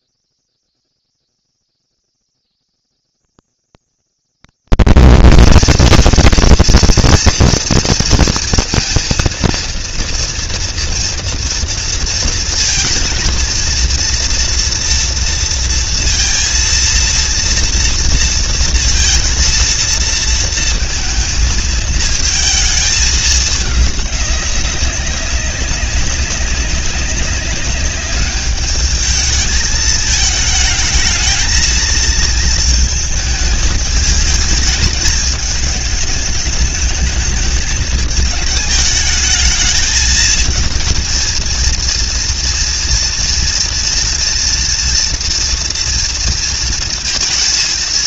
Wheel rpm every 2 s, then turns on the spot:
230, 230, 230, 230, 230, 230, 230, 230, 230, 230, 230, 220, 190, 190, 210, 220, 220, 220, 220, 220, 230, 230, 230, 230.
none